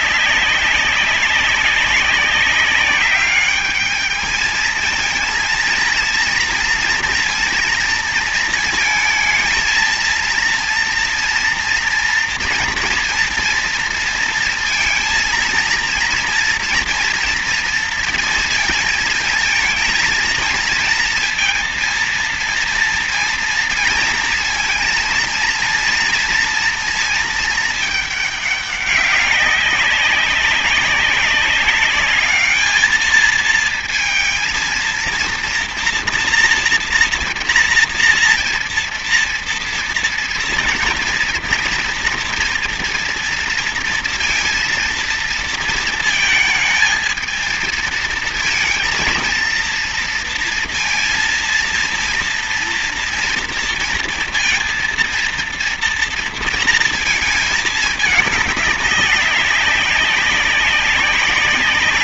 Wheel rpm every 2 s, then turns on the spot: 190, 200, 220, 230, 230, 230, 230, 230, 230, 230, 230, 230, 230, 230, 200, 200, 210, 230, 230, 230, 230, 230, 230, 220, 230, 230, 230, 230, 230, 200, 200.
none